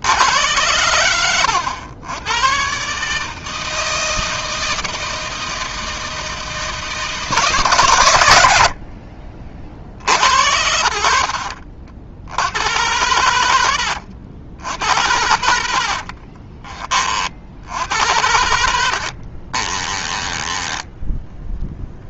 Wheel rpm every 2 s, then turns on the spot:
100, 130, 160, 160, 60, 60, 90, 80, 30, 70, 10.
18-22